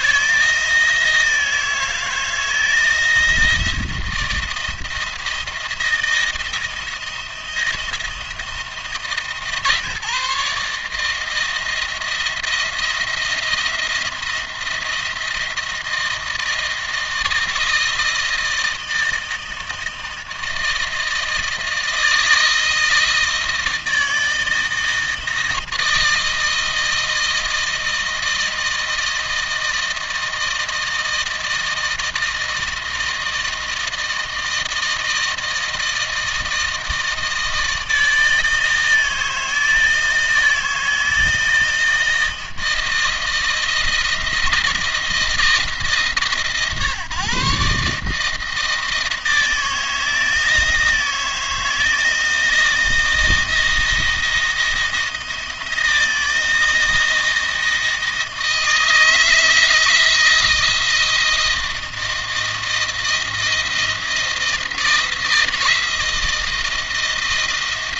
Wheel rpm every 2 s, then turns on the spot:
160, 160, 160, 170, 160, 160, 170, 170, 160, 160, 160, 160, 160, 160, 160, 160, 160, 160, 160, 160, 160, 160, 170, 140, 160, 160, 160, 170, 160, 160, 170, 160, 160, 160.
none